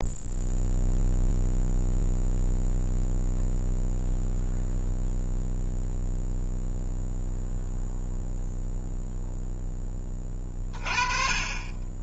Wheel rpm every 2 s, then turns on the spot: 0, 0, 0, 0, 0, 30.
none